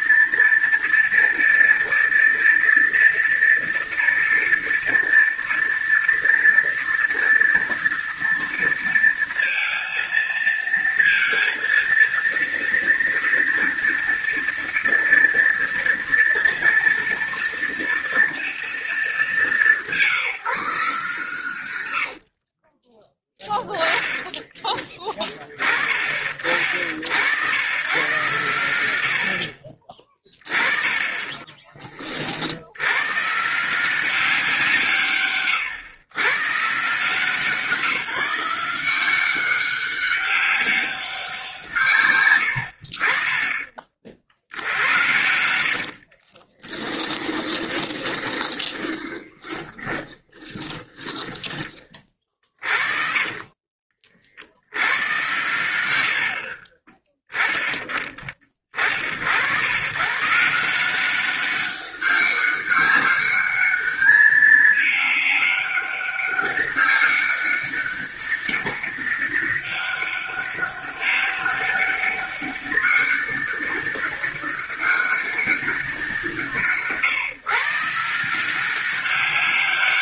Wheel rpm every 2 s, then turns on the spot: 230, 230, 230, 230, 230, 230, 230, 230, 230, 230, 170, 50, 10, 40, 100, 30, 60, 180, 130, 170, 200, 100, 60, 30, 20, 30, 50, 60, 50, 30, 140, 200, 210, 200, 200, 200, 200, 200, 150, 170.
22-24 46-54 56-58